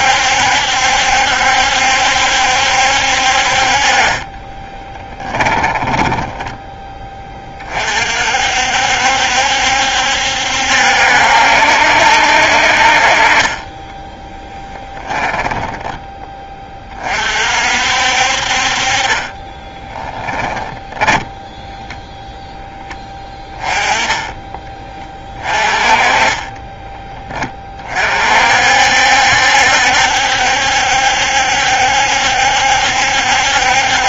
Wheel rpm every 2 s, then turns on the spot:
70, 70, 20, 20, 60, 70, 40, 10, 20, 40, 10, 10, 10, 20, 60, 70, 70.
4-6 20-22 26-28